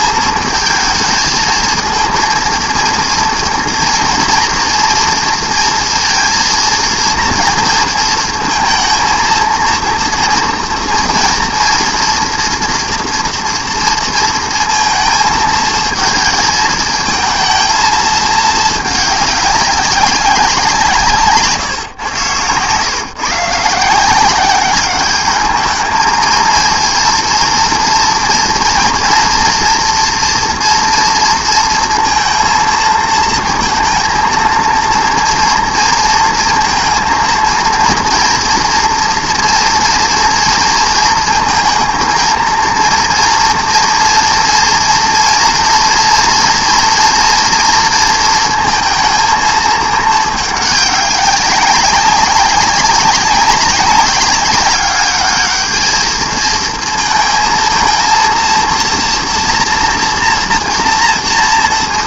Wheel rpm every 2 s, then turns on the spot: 220, 230, 230, 230, 220, 230, 230, 220, 220, 210, 170, 130, 200, 230, 230, 230, 230, 230, 230, 240, 230, 230, 230, 230, 230, 200, 200, 200, 220, 230, 230.
none